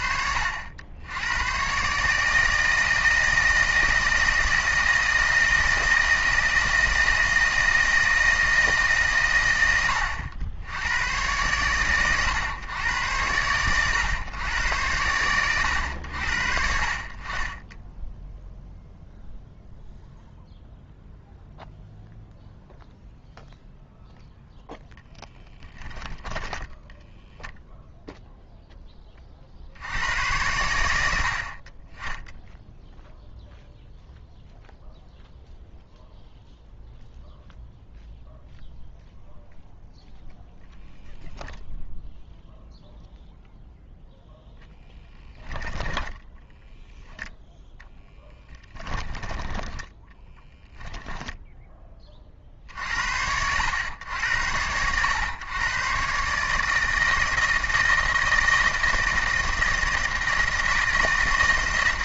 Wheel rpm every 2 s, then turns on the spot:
70, 160, 160, 160, 160, 90, 110, 100, 50, 0, 0, 0, 0, 10, 0, 90, 0, 0, 0, 0, 10, 0, 0, 10, 10, 10, 50, 90, 150, 160, 160.
26-28